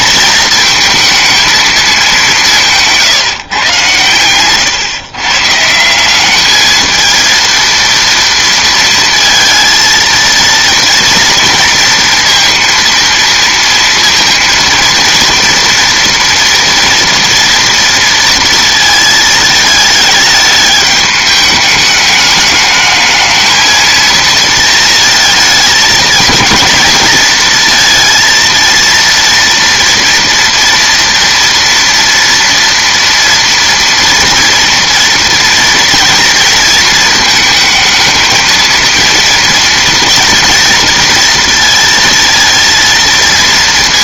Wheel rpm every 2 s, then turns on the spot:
220, 170, 140, 210, 230, 230, 230, 230, 230, 230, 210, 210, 230, 220, 230, 230, 230, 230, 230, 220, 230, 230.
none